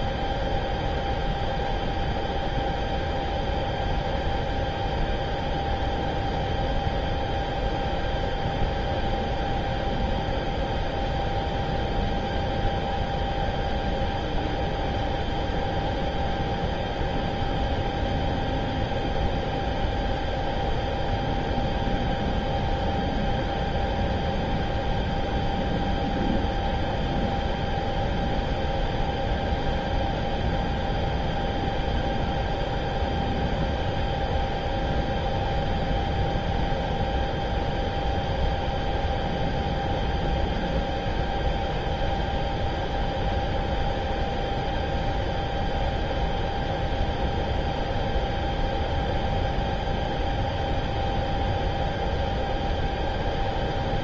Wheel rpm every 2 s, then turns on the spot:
0, 0, 0, 0, 0, 0, 0, 0, 0, 0, 0, 0, 0, 0, 0, 0, 0, 0, 0, 0, 0, 0, 0, 0, 0, 0, 0.
none